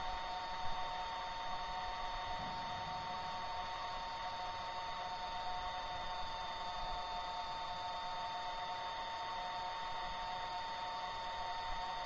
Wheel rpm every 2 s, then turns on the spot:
0, 0, 0, 0, 0, 0.
none